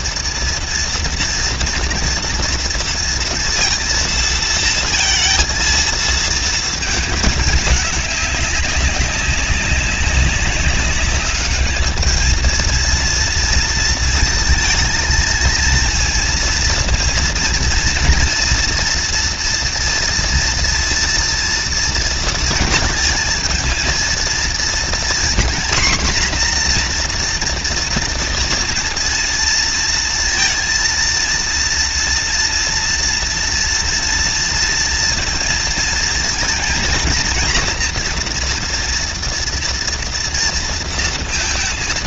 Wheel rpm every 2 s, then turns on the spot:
230, 240, 230, 230, 200, 190, 220, 230, 230, 230, 230, 230, 230, 250, 230, 230, 230, 230, 230, 240, 230.
none